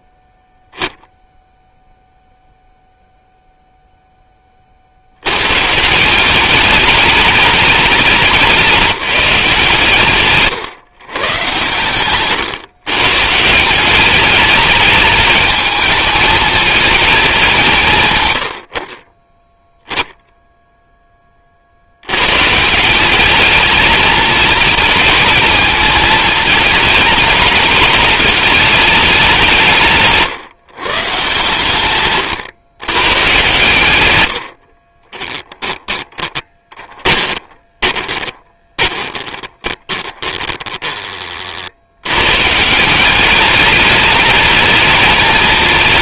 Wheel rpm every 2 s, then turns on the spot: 0, 0, 70, 210, 190, 130, 130, 210, 220, 20, 10, 180, 220, 220, 210, 140, 120, 40, 20, 20, 20, 180, 220.
34-40